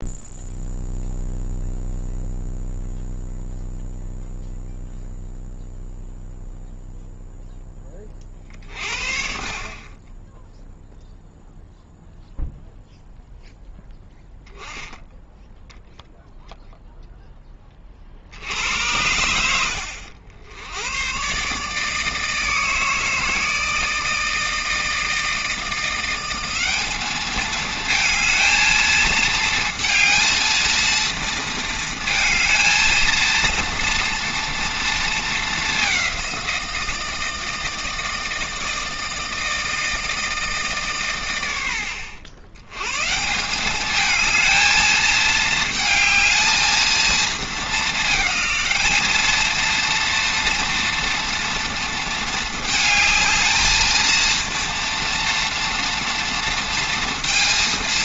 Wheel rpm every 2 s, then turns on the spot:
0, 0, 0, 0, 50, 0, 0, 10, 0, 80, 100, 160, 160, 200, 220, 230, 220, 220, 170, 160, 140, 130, 220, 230, 210, 240, 220, 230, 230.
none